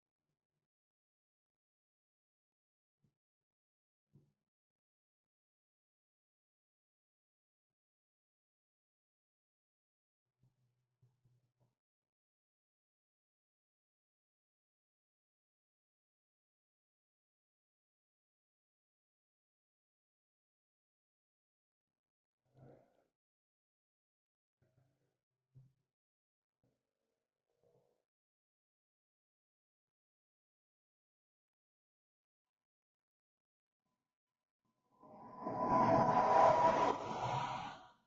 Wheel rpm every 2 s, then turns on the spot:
0, 0, 0, 0, 0, 0, 0, 0, 0, 0, 0, 0, 0, 0, 0, 0, 0, 0, 0.
none